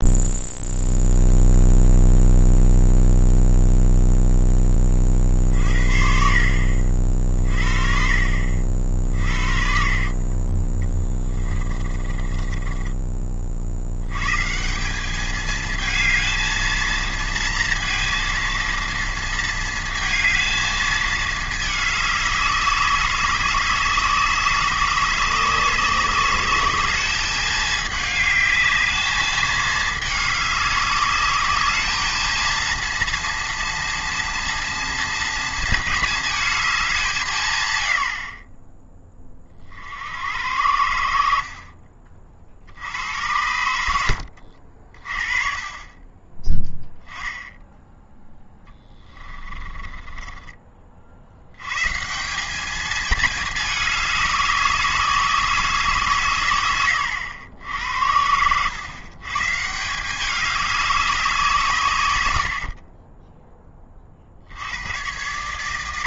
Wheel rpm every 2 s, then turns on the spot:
0, 0, 30, 50, 50, 20, 20, 190, 230, 230, 220, 200, 200, 210, 210, 200, 230, 240, 200, 20, 70, 80, 50, 10, 10, 40, 220, 190, 110, 120, 200, 40, 90.
10-14 48-50